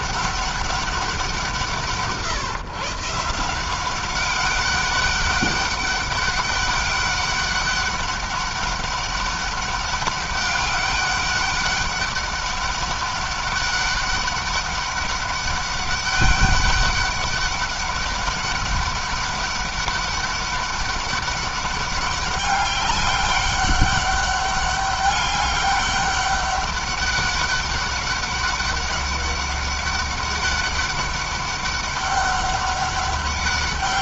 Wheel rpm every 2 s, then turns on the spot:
190, 140, 200, 200, 200, 200, 200, 200, 200, 200, 200, 200, 200, 200, 190, 200, 200.
none